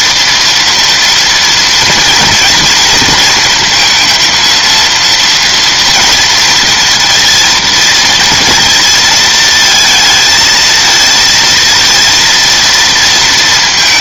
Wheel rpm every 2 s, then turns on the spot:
240, 230, 230, 230, 230, 220, 230.
none